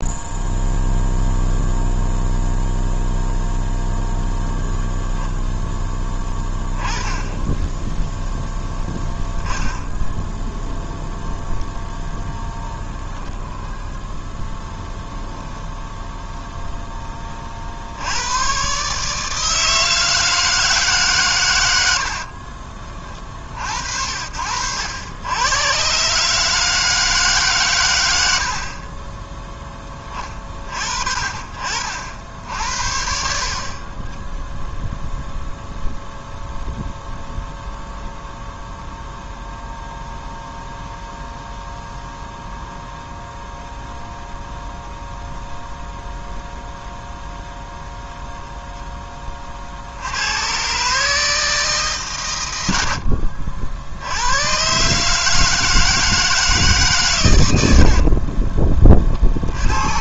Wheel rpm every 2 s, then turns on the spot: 0, 0, 0, 10, 10, 0, 20, 0, 20, 140, 140, 30, 90, 160, 40, 40, 60, 0, 0, 0, 0, 0, 0, 0, 10, 140, 70, 140, 130, 30.
12-14 58-60